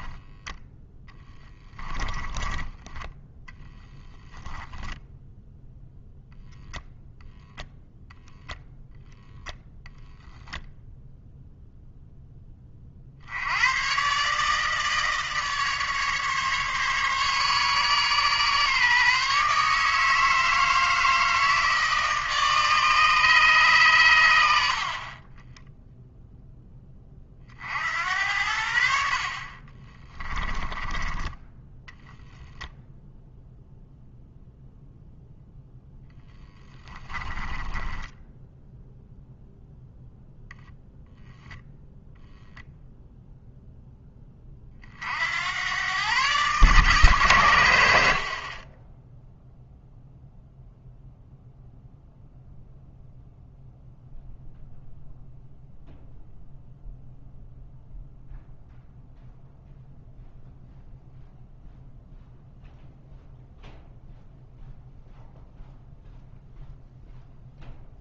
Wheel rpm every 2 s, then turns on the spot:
10, 20, 10, 0, 0, 0, 40, 150, 140, 140, 160, 150, 70, 20, 60, 20, 0, 0, 10, 0, 0, 0, 50, 140, 10, 0, 0, 0, 0, 0, 0, 0, 0, 0.
2-4 30-32 36-38